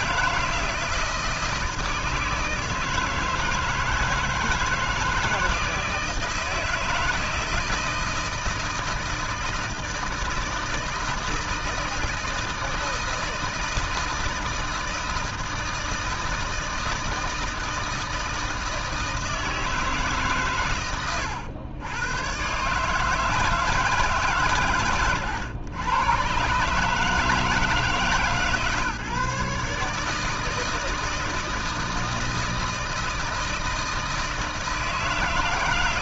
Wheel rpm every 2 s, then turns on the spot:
160, 160, 160, 160, 160, 160, 160, 160, 160, 160, 130, 110, 150, 140, 150, 160, 160, 160.
none